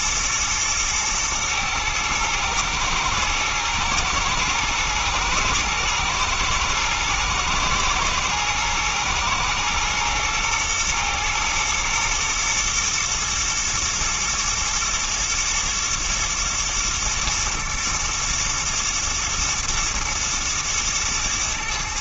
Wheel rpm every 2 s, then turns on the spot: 110, 110, 110, 110, 110, 110, 120, 110, 110, 110, 110.
none